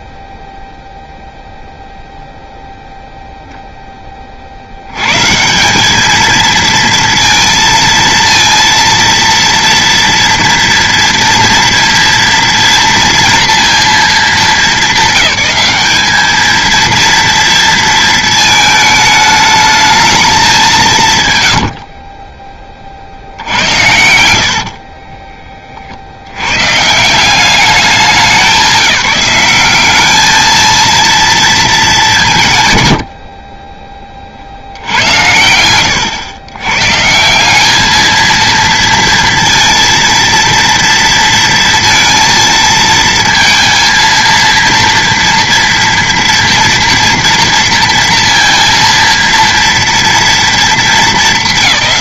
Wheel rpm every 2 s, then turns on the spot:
0, 0, 50, 220, 230, 230, 230, 200, 220, 220, 180, 40, 40, 130, 200, 230, 100, 110, 140, 230, 230, 230, 230, 230, 230, 220.
24-26 32-36